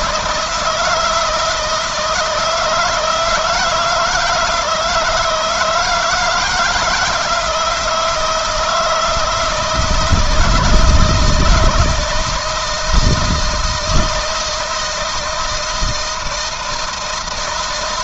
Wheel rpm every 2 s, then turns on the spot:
160, 160, 160, 170, 160, 160, 160, 160, 160.
none